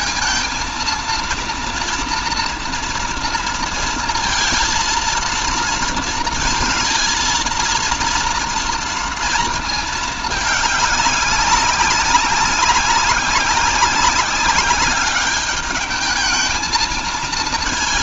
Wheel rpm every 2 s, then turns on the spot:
230, 240, 230, 230, 230, 210, 190, 200, 220.
none